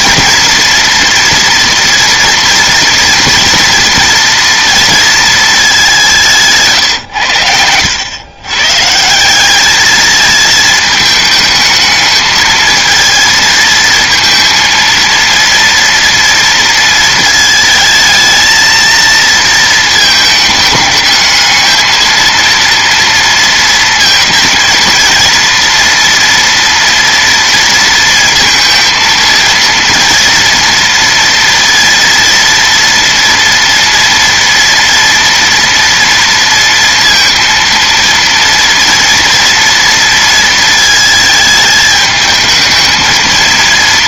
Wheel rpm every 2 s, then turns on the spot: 230, 230, 230, 140, 140, 220, 220, 230, 230, 220, 210, 230, 230, 230, 230, 230, 230, 230, 230, 230, 230, 220.
6-8